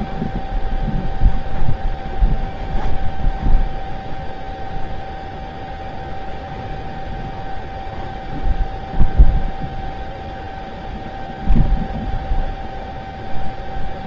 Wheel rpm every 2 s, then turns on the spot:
0, 0, 0, 0, 0, 0, 0.
none